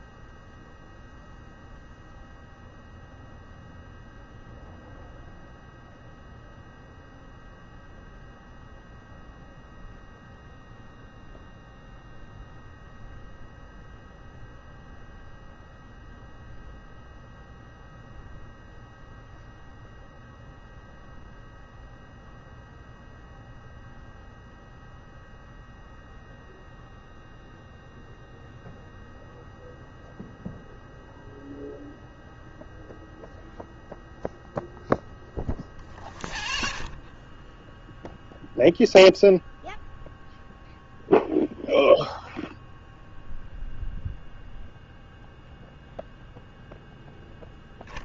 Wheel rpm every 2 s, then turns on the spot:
0, 0, 0, 0, 0, 0, 0, 0, 0, 0, 0, 0, 0, 0, 0, 0, 0, 0, 0, 0, 0, 0, 0, 0.
none